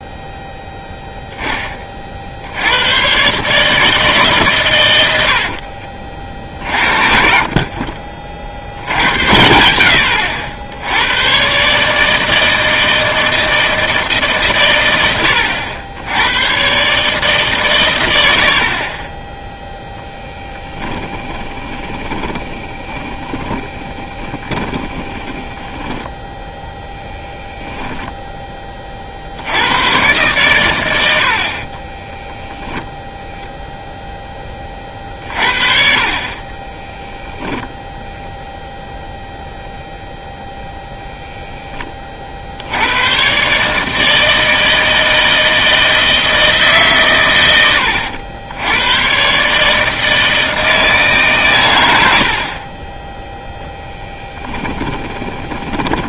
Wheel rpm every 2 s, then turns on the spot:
0, 100, 120, 50, 80, 90, 160, 110, 130, 30, 10, 10, 20, 10, 30, 100, 0, 30, 20, 0, 0, 90, 160, 140, 100, 150, 20, 20.
20-26 36-38 54-56